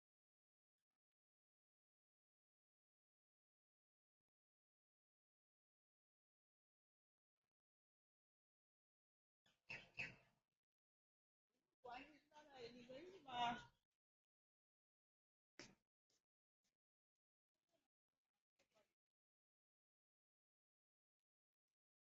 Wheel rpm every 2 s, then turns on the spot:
0, 0, 0, 0, 0, 0, 0, 0, 0, 0, 0.
none